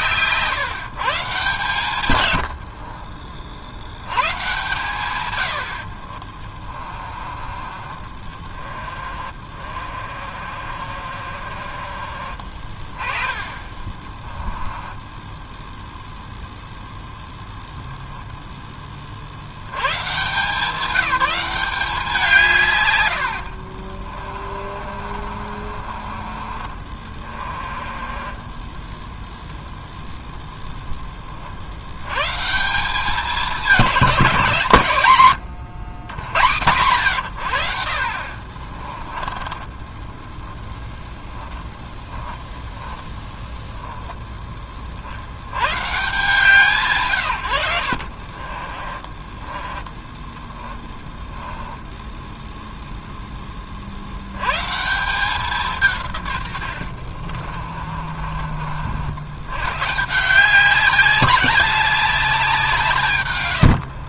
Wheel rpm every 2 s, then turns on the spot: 150, 70, 130, 30, 30, 40, 30, 20, 0, 10, 180, 140, 40, 40, 20, 0, 150, 170, 110, 30, 10, 10, 10, 140, 30, 20, 0, 130, 100, 50, 180, 180.
2-4 6-12 14-16 24-26 28-30 38-40 42-44 48-52 56-58